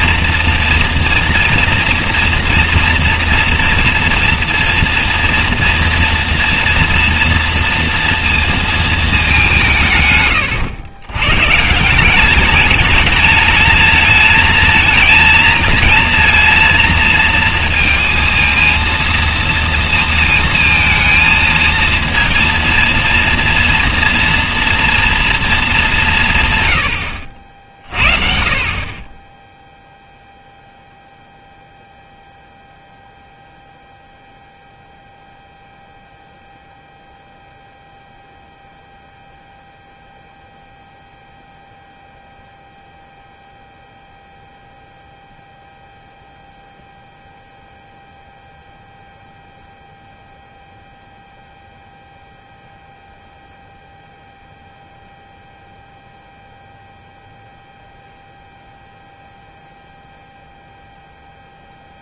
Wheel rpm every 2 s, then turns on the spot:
230, 230, 230, 240, 230, 110, 200, 220, 230, 230, 220, 230, 230, 130, 50, 0, 0, 0, 0, 0, 0, 0, 0, 0, 0, 0, 0, 0, 0, 0, 0.
none